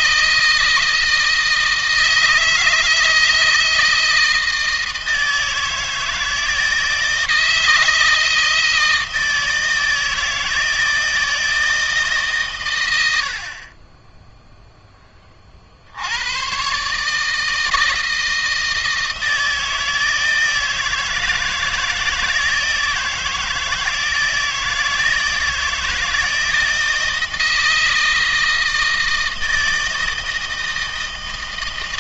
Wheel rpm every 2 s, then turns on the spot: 160, 160, 160, 160, 160, 160, 100, 10, 140, 160, 160, 160, 160, 170, 160, 160.
none